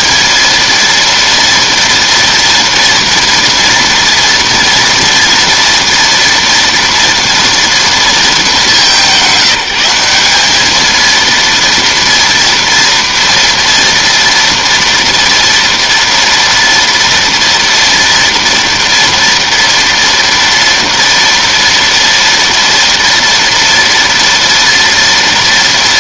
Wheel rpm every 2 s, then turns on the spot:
230, 230, 230, 230, 200, 220, 230, 230, 230, 230, 230, 240, 230.
none